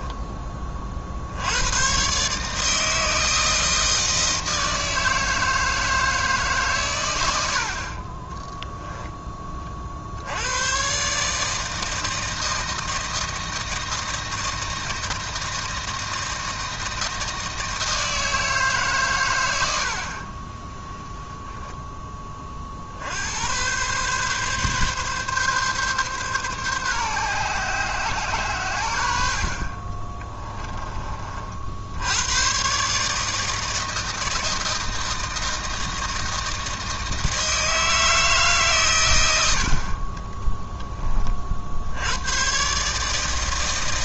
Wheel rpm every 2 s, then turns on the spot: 30, 150, 160, 140, 10, 120, 160, 160, 160, 150, 10, 40, 140, 130, 100, 20, 130, 160, 160, 140, 30, 140.
8-10 30-32 40-42